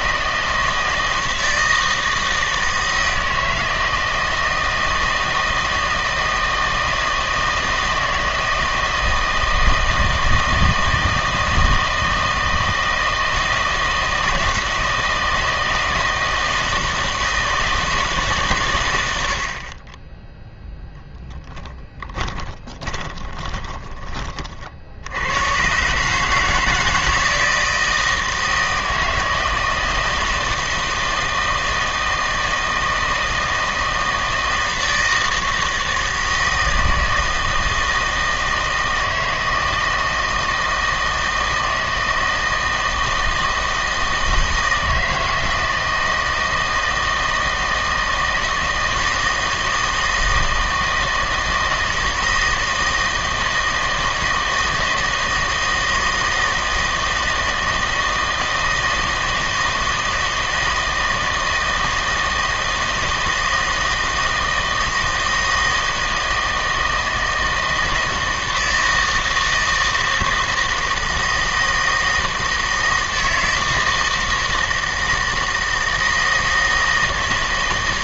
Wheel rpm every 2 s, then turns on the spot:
160, 160, 160, 160, 160, 160, 160, 160, 160, 120, 10, 20, 70, 160, 160, 160, 160, 160, 160, 160, 160, 160, 160, 160, 160, 160, 160, 160, 160, 160, 160, 160, 160, 160, 160, 160, 160, 160, 160.
22-24